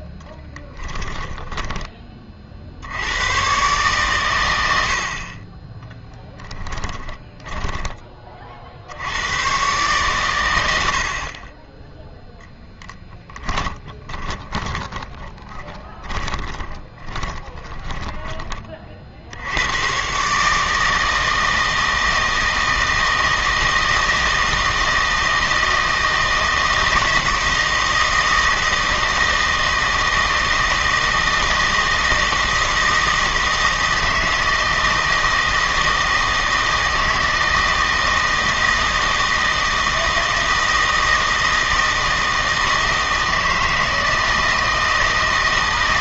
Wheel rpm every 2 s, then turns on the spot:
20, 60, 80, 10, 60, 90, 0, 20, 20, 30, 150, 160, 160, 160, 160, 160, 160, 160, 160, 160, 160, 160, 160.
0-2 6-8 14-18